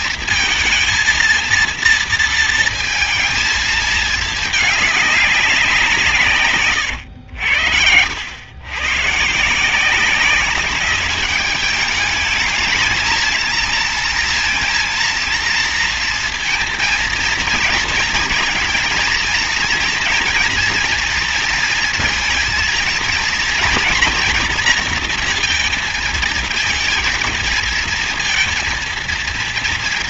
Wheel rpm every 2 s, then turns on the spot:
230, 230, 210, 120, 120, 200, 210, 230, 230, 220, 230, 230, 240, 220, 230.
none